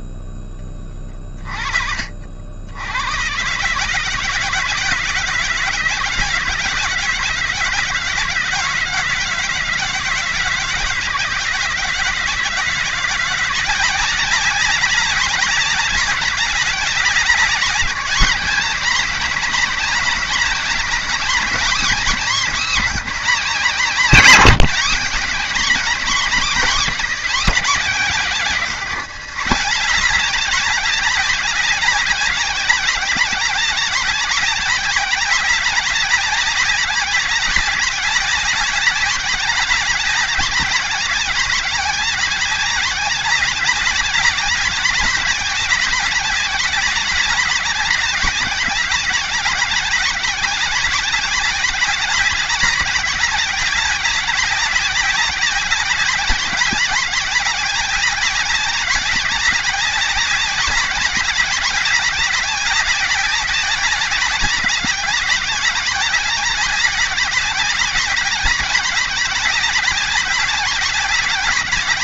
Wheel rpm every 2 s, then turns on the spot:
20, 90, 160, 170, 160, 170, 160, 190, 190, 180, 190, 190, 170, 220, 180, 190, 190, 190, 190, 190, 190, 190, 200, 200, 190, 190, 200, 190, 190, 190, 200, 190, 200, 200, 190, 200.
none